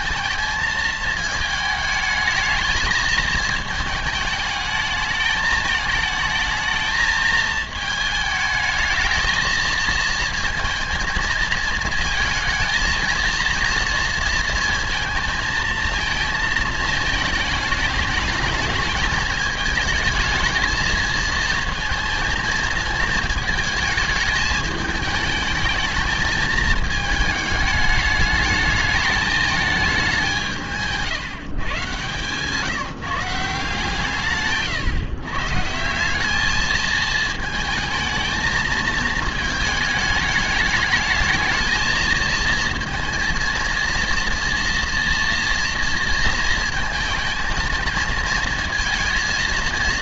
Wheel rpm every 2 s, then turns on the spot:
220, 220, 210, 220, 220, 230, 220, 230, 220, 210, 220, 220, 220, 220, 210, 170, 160, 140, 210, 220, 220, 230, 230, 230, 220.
none